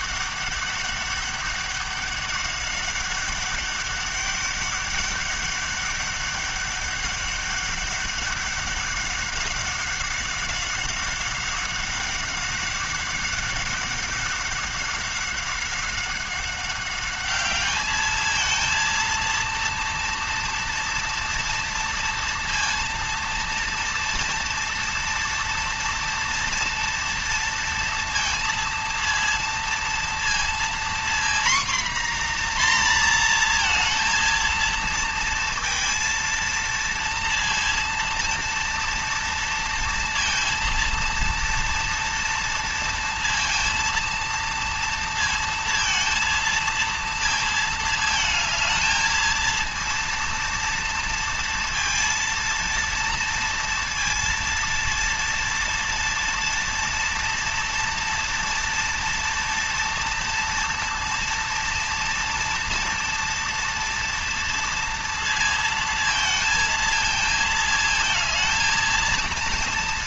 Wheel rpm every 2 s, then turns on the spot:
200, 200, 200, 200, 200, 190, 190, 200, 200, 220, 230, 230, 230, 230, 230, 230, 250, 230, 230, 230, 230, 230, 230, 230, 220, 230, 230, 230, 230, 230, 230, 230, 230, 220, 220.
none